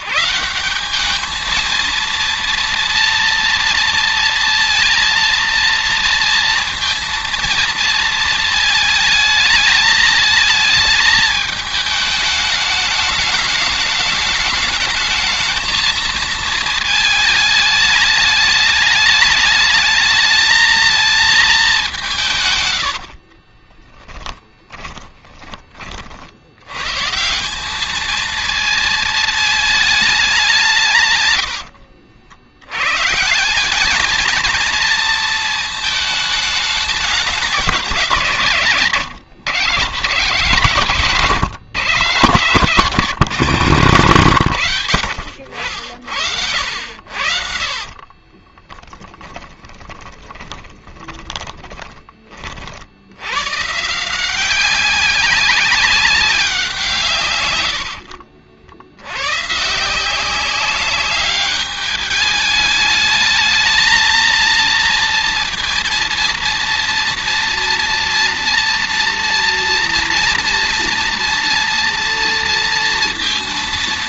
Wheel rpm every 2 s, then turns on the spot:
210, 230, 230, 230, 220, 220, 210, 220, 210, 210, 220, 60, 30, 160, 220, 110, 170, 230, 190, 120, 150, 150, 100, 60, 20, 20, 90, 190, 150, 70, 200, 210, 230, 230, 230, 230, 230.
22-26 30-32 46-52